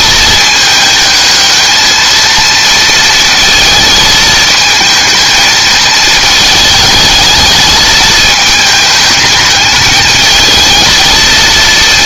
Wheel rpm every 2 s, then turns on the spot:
220, 230, 220, 220, 210, 220.
none